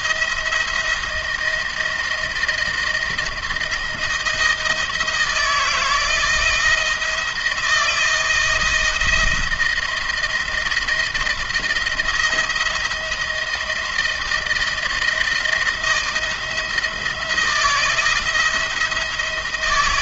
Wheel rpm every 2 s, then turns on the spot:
170, 160, 160, 170, 160, 170, 170, 170, 160, 170.
none